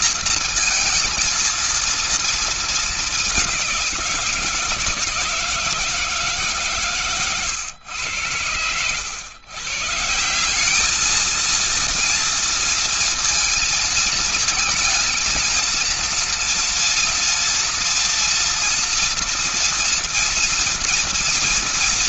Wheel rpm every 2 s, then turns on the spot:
230, 230, 170, 150, 100, 180, 230, 230, 230, 230, 240.
none